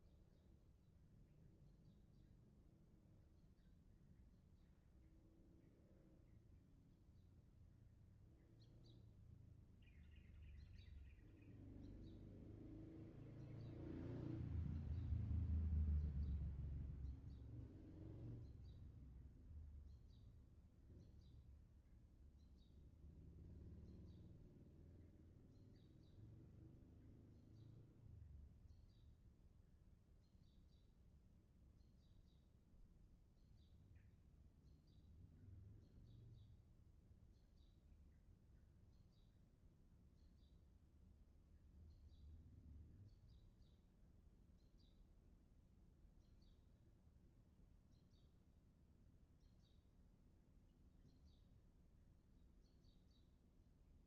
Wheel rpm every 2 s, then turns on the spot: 0, 0, 0, 0, 0, 0, 0, 0, 0, 0, 0, 0, 0, 0, 0, 0, 0, 0, 0, 0, 0, 0, 0, 0, 0, 0, 0.
none